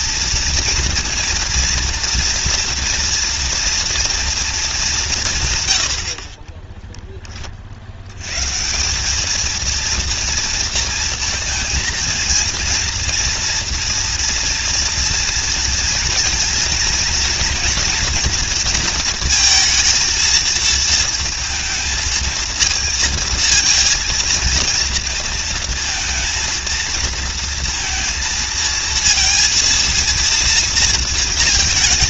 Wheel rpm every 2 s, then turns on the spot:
240, 230, 220, 30, 160, 230, 230, 230, 230, 230, 230, 230, 230, 230, 230, 230.
6-8